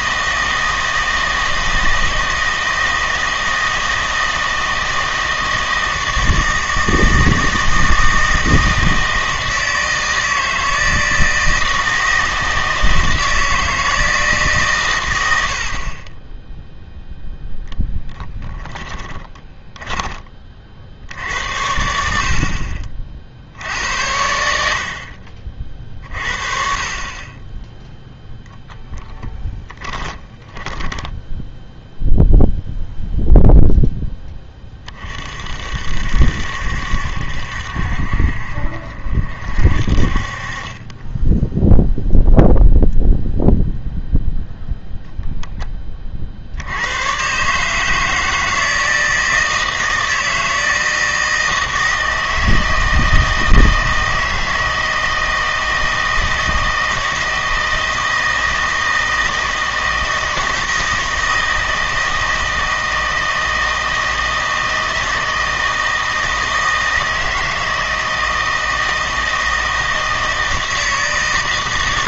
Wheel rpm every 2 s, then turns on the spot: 160, 160, 160, 160, 160, 160, 160, 130, 0, 10, 60, 40, 70, 40, 0, 10, 0, 30, 70, 50, 30, 0, 0, 80, 160, 160, 160, 160, 160, 160, 160, 160, 160, 160, 160, 160.
18-20 30-32